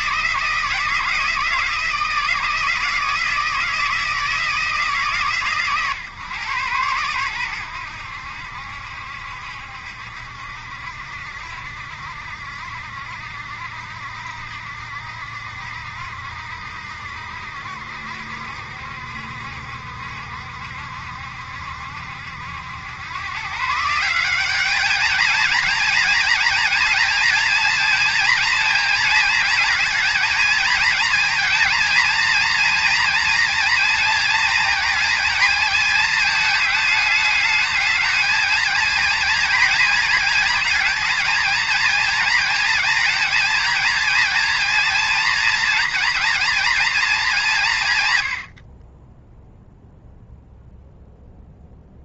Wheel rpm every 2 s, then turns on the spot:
160, 160, 150, 110, 70, 70, 70, 70, 70, 70, 70, 100, 220, 230, 220, 220, 230, 230, 210, 230, 230, 220, 230, 220, 20, 0.
none